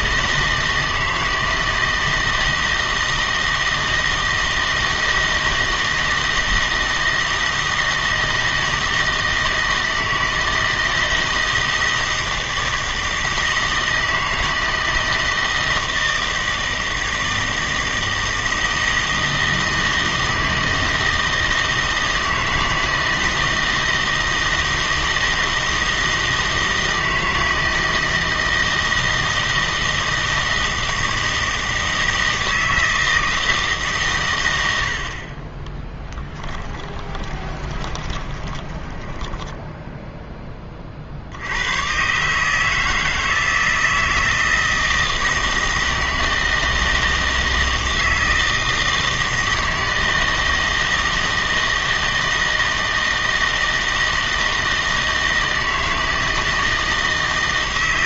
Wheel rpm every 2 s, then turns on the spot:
160, 160, 160, 160, 160, 160, 160, 160, 160, 160, 160, 160, 160, 160, 160, 160, 160, 80, 20, 20, 30, 160, 160, 160, 160, 160, 160, 160, 160.
36-40